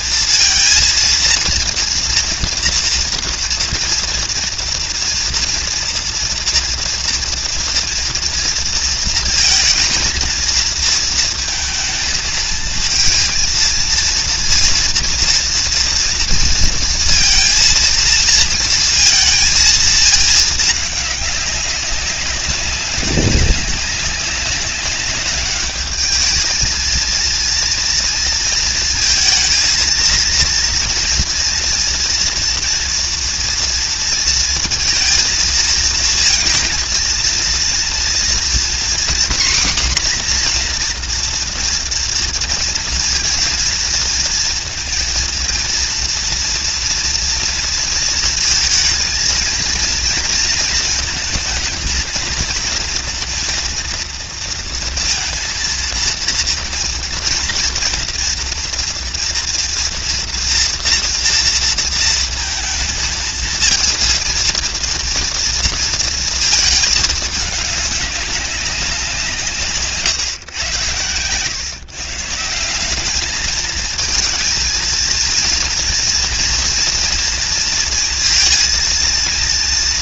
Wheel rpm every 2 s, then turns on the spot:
230, 230, 230, 230, 230, 230, 230, 230, 230, 230, 220, 200, 200, 200, 230, 230, 230, 230, 230, 230, 260, 230, 230, 230, 230, 220, 230, 230, 230, 230, 240, 230, 220, 230, 200, 150, 140, 220, 230, 230.
none